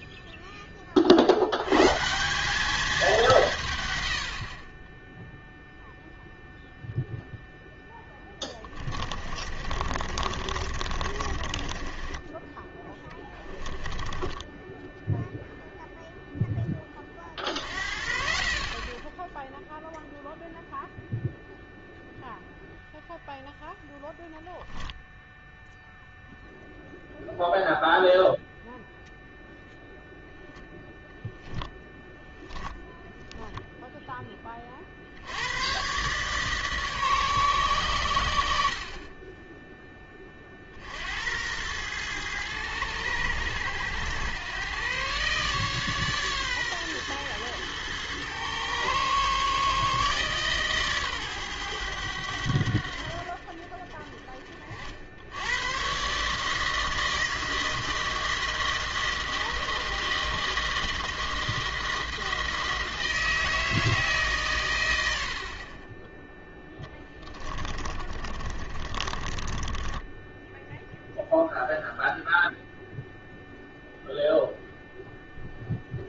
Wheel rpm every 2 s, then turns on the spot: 10, 190, 50, 0, 20, 50, 20, 10, 10, 50, 0, 0, 0, 0, 0, 0, 10, 20, 140, 70, 40, 110, 110, 130, 120, 140, 80, 50, 150, 160, 160, 160, 130, 10, 30, 10, 0, 0.
8-16 68-70